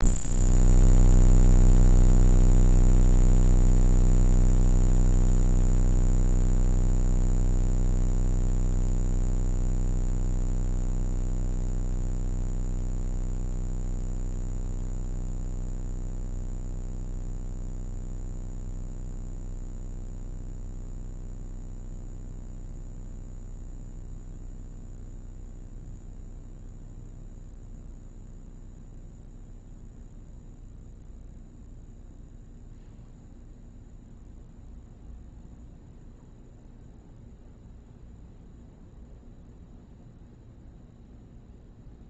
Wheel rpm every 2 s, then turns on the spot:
0, 0, 0, 0, 0, 0, 0, 0, 0, 0, 0, 0, 0, 0, 0, 0, 0, 0, 0, 0, 0.
none